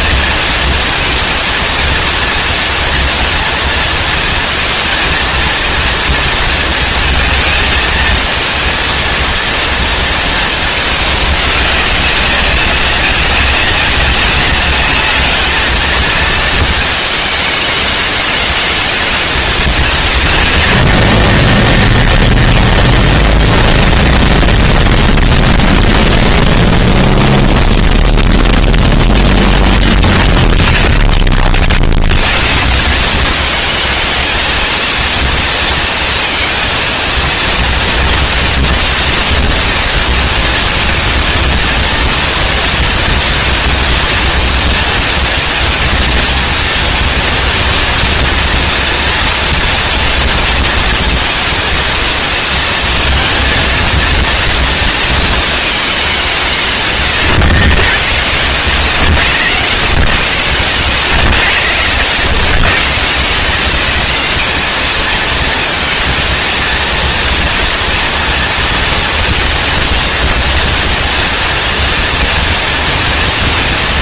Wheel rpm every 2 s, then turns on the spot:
230, 230, 230, 230, 220, 230, 190, 200, 220, 210, 110, 0, 0, 0, 0, 10, 100, 220, 230, 230, 230, 230, 230, 230, 230, 230, 230, 230, 180, 90, 100, 110, 200, 230, 230, 240, 240.
30-32 58-60